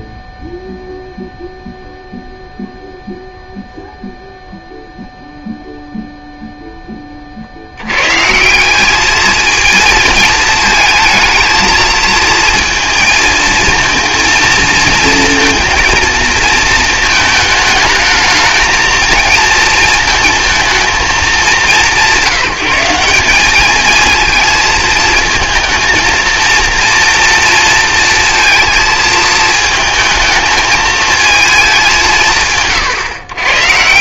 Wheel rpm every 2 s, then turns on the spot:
0, 0, 0, 10, 190, 230, 230, 230, 220, 220, 230, 170, 220, 230, 230, 220, 140.
none